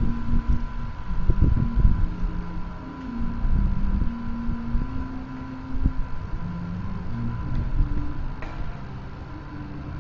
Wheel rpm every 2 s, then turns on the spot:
0, 0, 0, 0, 0.
none